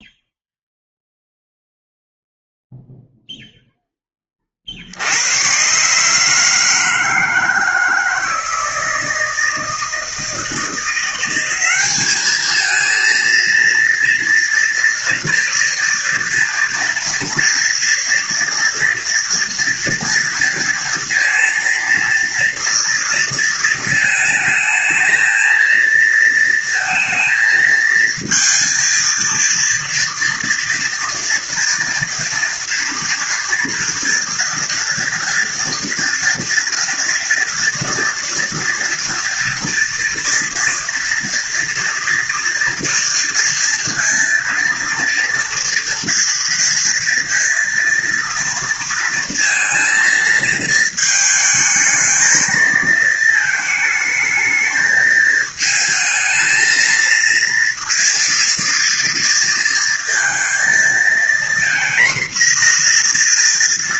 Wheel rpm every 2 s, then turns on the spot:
0, 0, 60, 160, 160, 170, 220, 230, 230, 230, 230, 230, 220, 220, 230, 230, 230, 230, 230, 230, 230, 230, 230, 230, 230, 220, 220, 220, 230, 230, 230, 240.
none